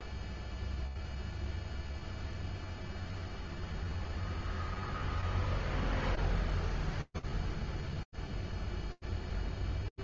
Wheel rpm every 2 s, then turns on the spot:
0, 0, 0, 0, 0.
none